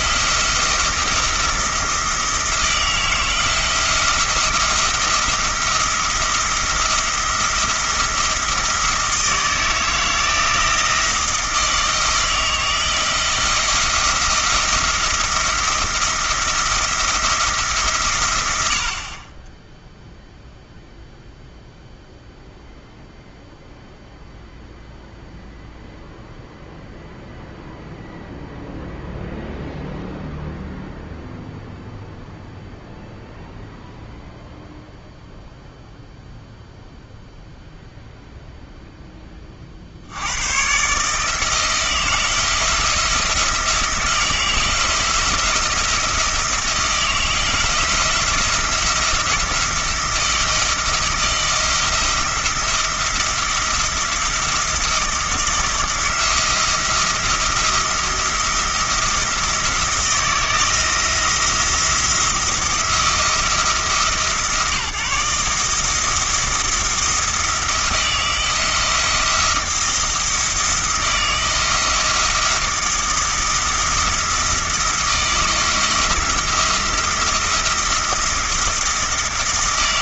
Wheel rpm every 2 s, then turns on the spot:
170, 160, 170, 170, 170, 170, 160, 170, 170, 70, 0, 0, 0, 0, 0, 0, 0, 0, 0, 0, 130, 160, 170, 160, 170, 170, 170, 170, 170, 170, 170, 170, 150, 170, 170, 160, 170, 170, 170, 170.
none